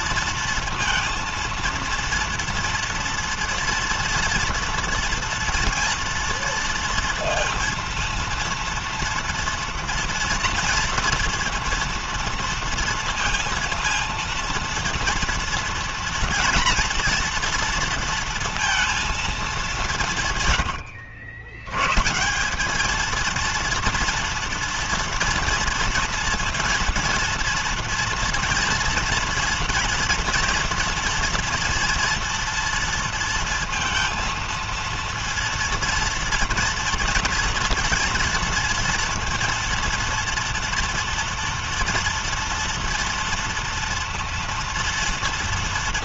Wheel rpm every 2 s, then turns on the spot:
230, 230, 230, 230, 230, 230, 230, 230, 240, 230, 100, 210, 230, 230, 230, 230, 230, 230, 230, 230, 230, 240, 230.
none